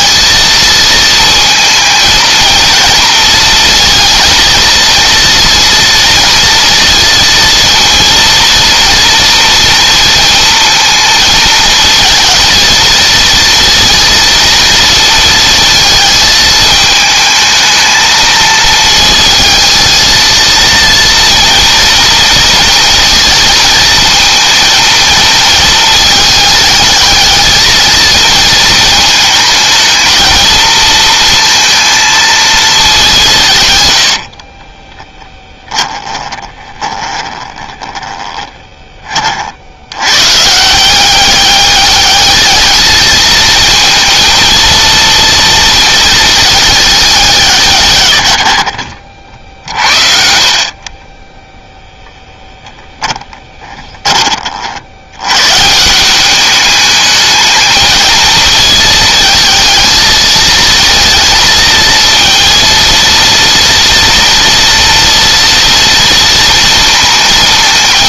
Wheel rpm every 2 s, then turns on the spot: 230, 230, 230, 230, 230, 230, 220, 230, 220, 220, 230, 230, 230, 220, 220, 220, 220, 30, 20, 20, 160, 220, 230, 220, 70, 40, 10, 50, 200, 220, 230, 230, 230, 230.
34-38 50-52